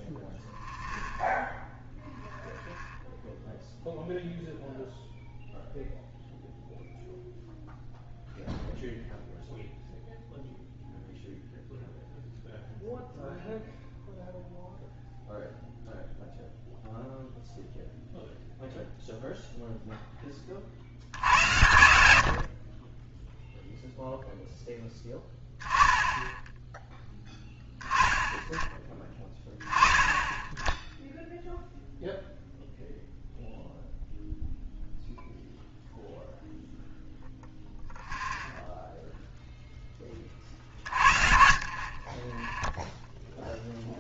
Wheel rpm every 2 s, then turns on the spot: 0, 0, 0, 0, 0, 0, 0, 0, 0, 0, 40, 30, 10, 10, 10, 10, 0, 0, 0, 0, 40, 0.
none